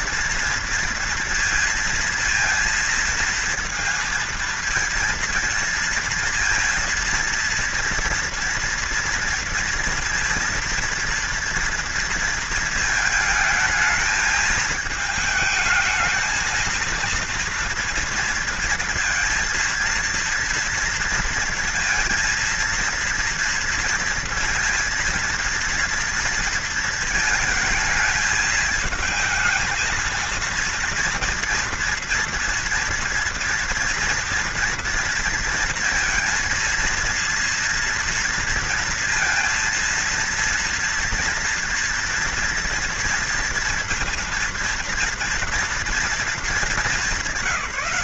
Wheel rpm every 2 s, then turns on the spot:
230, 230, 230, 230, 230, 230, 220, 220, 220, 230, 230, 230, 230, 230, 220, 230, 230, 230, 230, 230, 230, 230, 230, 200.
none